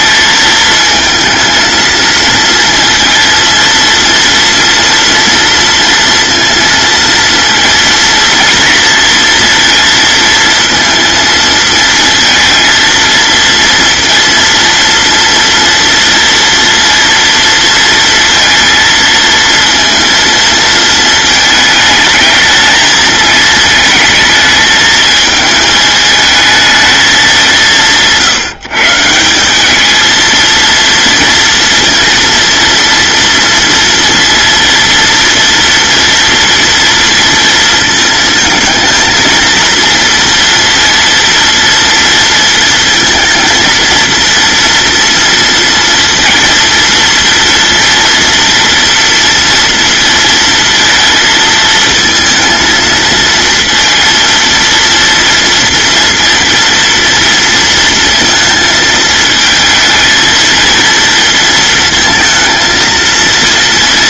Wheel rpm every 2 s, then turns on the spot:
220, 230, 230, 230, 230, 230, 230, 230, 230, 230, 220, 220, 220, 210, 160, 230, 230, 230, 230, 220, 230, 230, 230, 230, 230, 230, 230, 230, 230, 220, 230, 230.
none